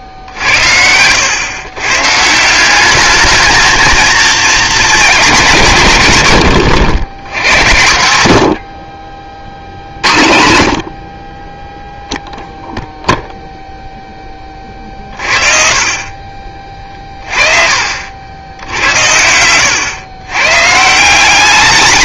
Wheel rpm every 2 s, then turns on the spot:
80, 190, 230, 100, 50, 60, 0, 40, 40, 80, 150.
16-18